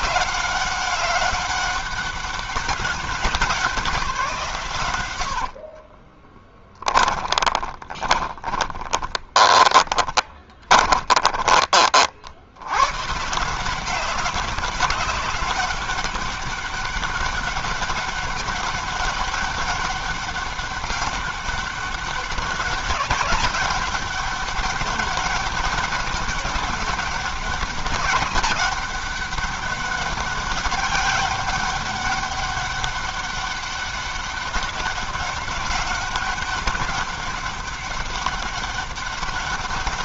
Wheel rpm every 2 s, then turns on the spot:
180, 190, 150, 20, 20, 20, 70, 190, 200, 200, 200, 190, 200, 200, 200, 200, 200, 200, 200, 200.
6-12